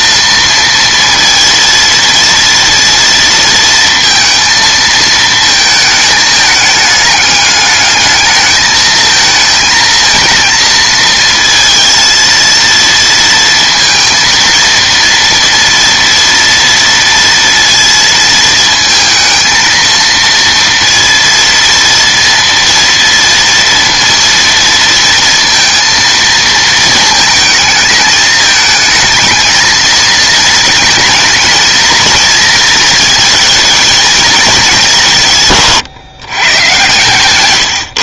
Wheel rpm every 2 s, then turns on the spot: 230, 230, 230, 210, 220, 230, 230, 230, 230, 220, 230, 230, 230, 220, 220, 220, 220, 180, 120.
none